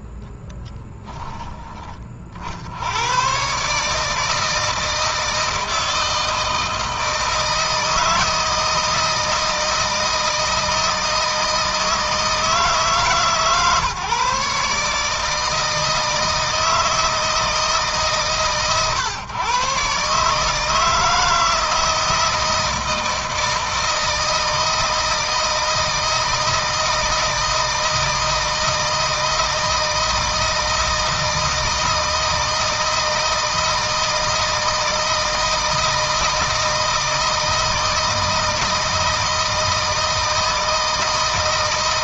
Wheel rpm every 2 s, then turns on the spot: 10, 90, 160, 160, 160, 160, 160, 160, 160, 130, 160, 160, 160, 160, 160, 160, 160, 160, 160, 160, 160.
none